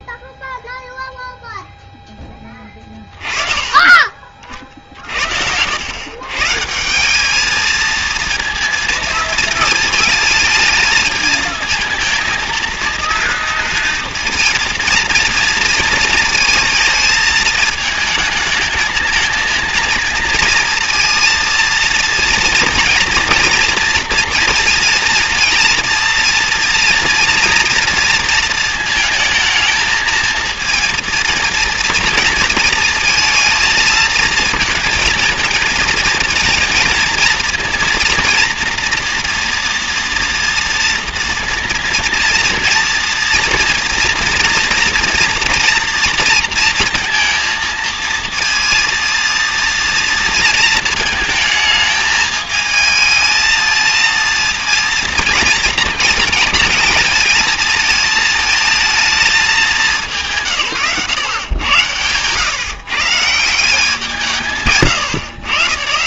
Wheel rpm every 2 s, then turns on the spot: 0, 20, 50, 160, 230, 220, 230, 230, 230, 220, 230, 230, 230, 230, 230, 230, 230, 230, 230, 240, 230, 230, 230, 230, 230, 220, 220, 230, 220, 220, 120, 140, 130.
2-6